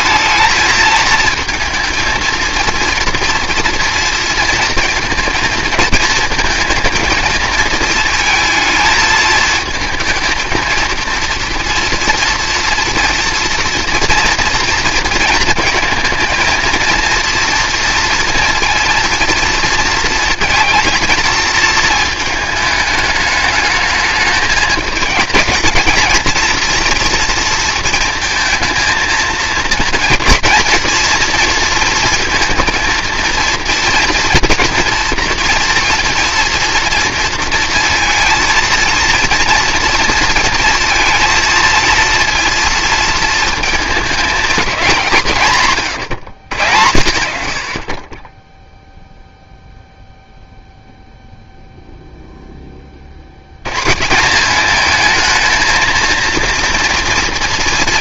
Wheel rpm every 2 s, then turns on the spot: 220, 230, 230, 220, 220, 230, 230, 230, 230, 230, 230, 210, 220, 230, 220, 230, 230, 230, 240, 230, 230, 230, 200, 100, 0, 0, 20, 210, 230.
none